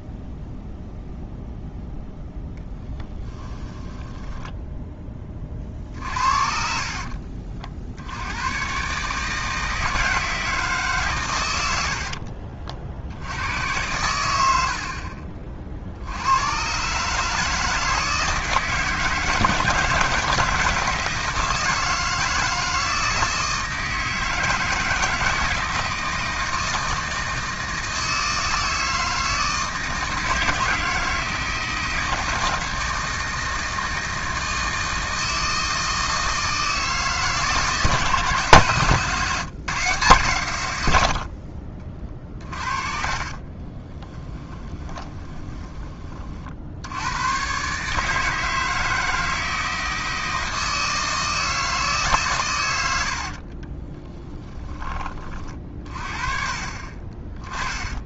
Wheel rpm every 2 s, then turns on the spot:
0, 0, 20, 50, 80, 160, 70, 90, 90, 160, 160, 160, 160, 160, 160, 160, 160, 160, 160, 150, 90, 40, 20, 80, 160, 160, 90, 20, 30.
4-8 12-14 42-46